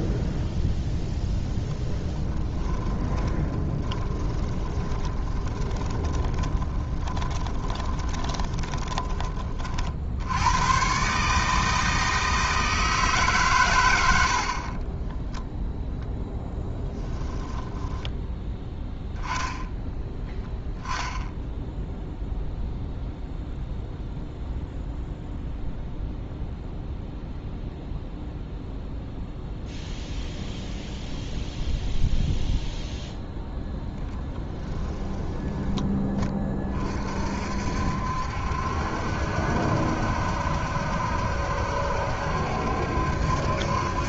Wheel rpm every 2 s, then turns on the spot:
0, 10, 20, 30, 20, 110, 160, 40, 10, 10, 0, 0, 0, 0, 0, 0, 0, 10, 30, 70, 70, 70.
2-10 16-18 34-36